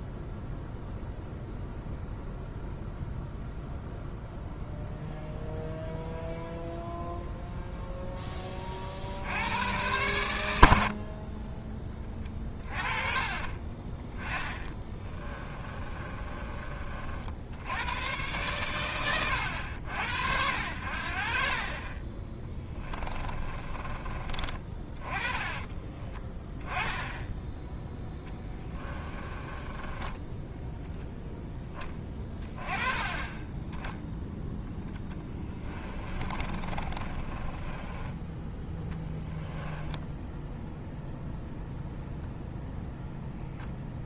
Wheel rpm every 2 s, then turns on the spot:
0, 0, 0, 0, 40, 70, 30, 20, 30, 130, 60, 20, 30, 10, 20, 10, 20, 10, 30, 10, 0, 0.
14-16 22-24 28-30 36-38